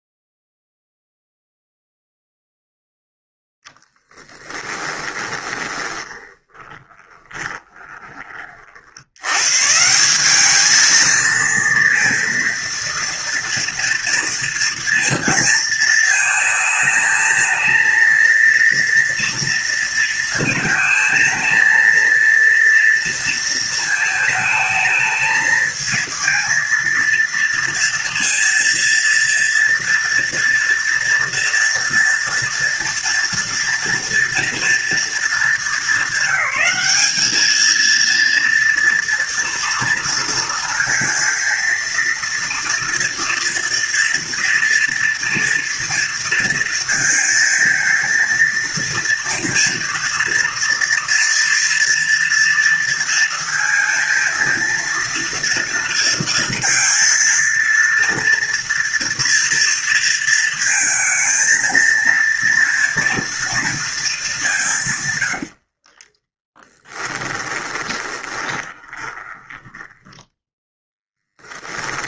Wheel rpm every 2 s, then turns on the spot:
0, 0, 10, 20, 30, 200, 230, 240, 220, 230, 230, 230, 220, 230, 230, 230, 230, 240, 200, 230, 230, 230, 230, 230, 230, 230, 230, 230, 230, 230, 230, 230, 200, 20, 20, 10.
4-8 66-70